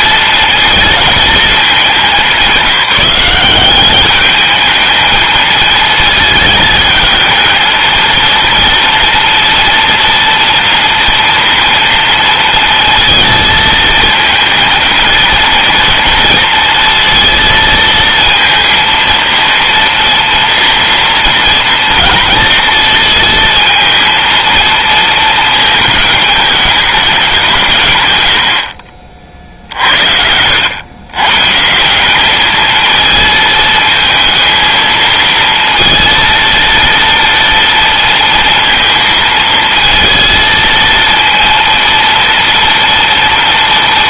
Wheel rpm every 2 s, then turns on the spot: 220, 180, 220, 220, 230, 230, 230, 230, 230, 230, 230, 230, 230, 210, 50, 120, 220, 220, 230, 230, 230, 230.
none